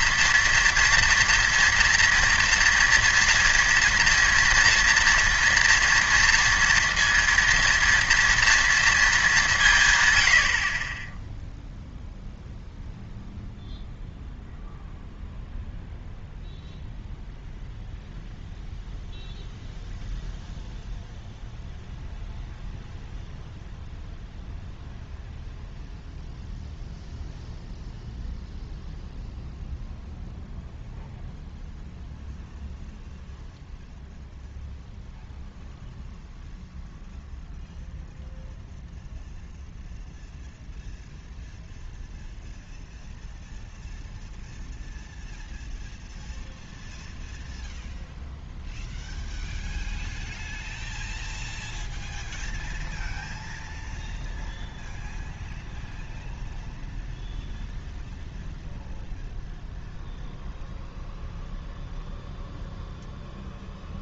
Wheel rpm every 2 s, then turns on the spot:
230, 230, 230, 230, 230, 50, 0, 0, 0, 0, 0, 0, 0, 0, 0, 0, 0, 0, 0, 0, 0, 0, 0, 0, 0, 0, 0, 0, 0, 0, 0, 0.
none